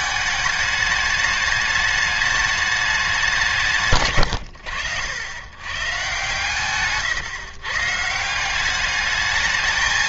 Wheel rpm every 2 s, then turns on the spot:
210, 210, 90, 130, 190.
none